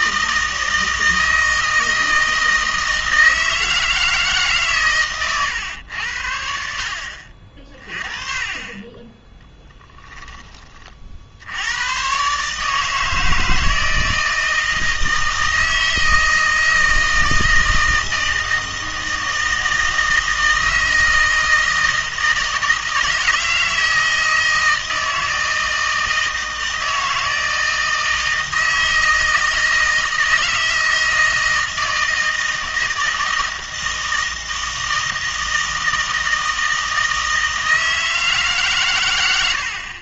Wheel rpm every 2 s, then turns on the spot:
160, 160, 140, 70, 30, 30, 150, 160, 160, 160, 160, 160, 160, 160, 160, 160, 160, 160, 160, 140.
none